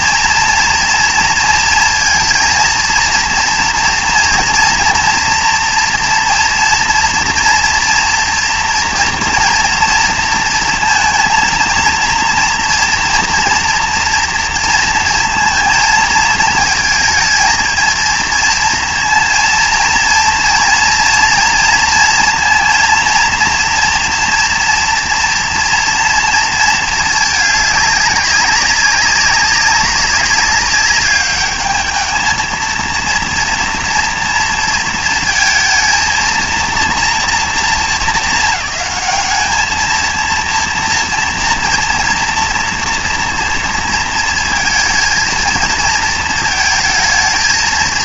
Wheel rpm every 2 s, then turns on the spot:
230, 230, 230, 230, 230, 230, 230, 230, 220, 230, 230, 230, 240, 220, 200, 200, 230, 230, 230, 210, 230, 230, 220, 220.
none